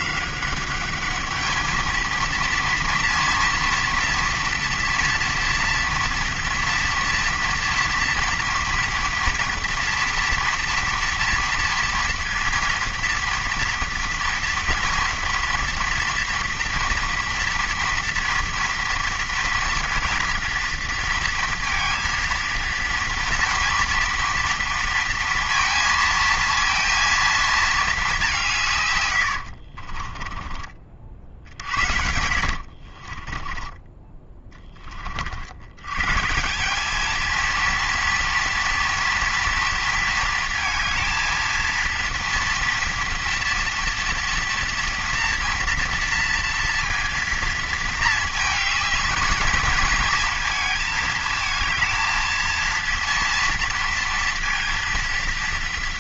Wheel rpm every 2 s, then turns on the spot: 200, 230, 230, 240, 230, 230, 230, 230, 230, 230, 230, 230, 230, 230, 150, 40, 60, 10, 180, 230, 230, 230, 230, 230, 210, 220, 230, 230.
32-34